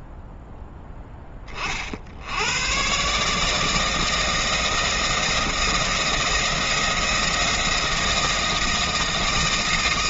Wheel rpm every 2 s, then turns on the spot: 20, 160, 160, 170, 160.
none